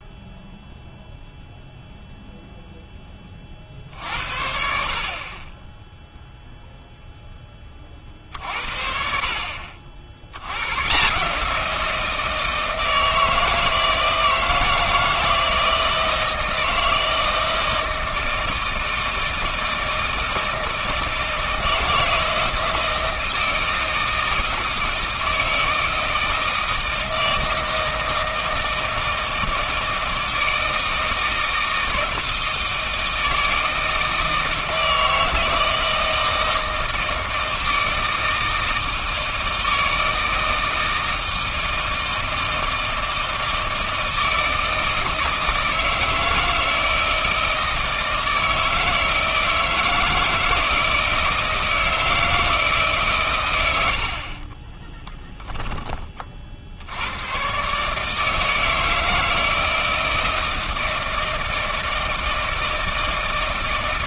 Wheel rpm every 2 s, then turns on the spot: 0, 10, 50, 0, 60, 120, 160, 160, 160, 160, 160, 160, 160, 160, 160, 160, 160, 160, 160, 160, 160, 160, 160, 160, 160, 160, 150, 10, 70, 160, 160, 160.
54-56